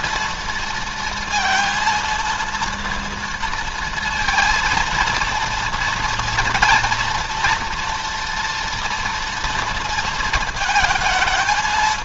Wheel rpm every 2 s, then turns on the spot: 230, 230, 230, 240, 230, 220.
none